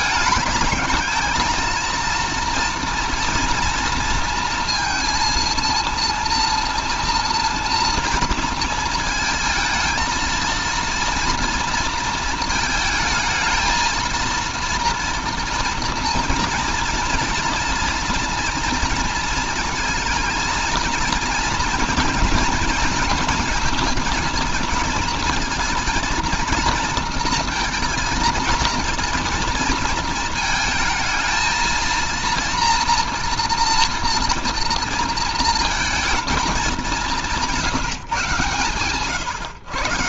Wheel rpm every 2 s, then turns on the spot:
220, 230, 230, 230, 230, 230, 220, 230, 230, 230, 230, 220, 220, 230, 230, 220, 230, 230, 210, 130.
none